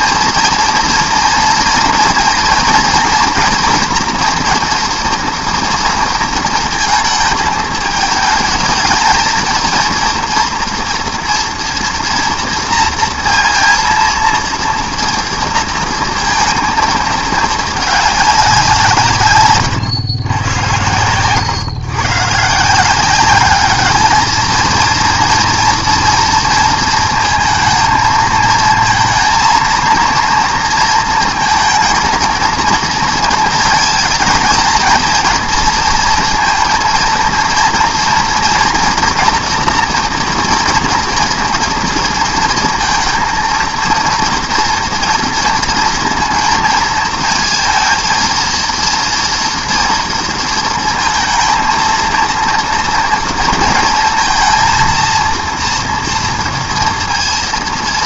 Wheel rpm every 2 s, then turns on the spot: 230, 230, 230, 230, 220, 230, 230, 230, 220, 180, 100, 160, 230, 230, 230, 230, 230, 230, 230, 230, 240, 230, 230, 230, 230, 230, 230, 230, 230.
none